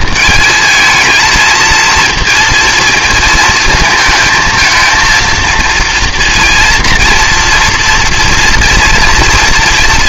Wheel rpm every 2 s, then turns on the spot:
220, 230, 220, 230, 240.
none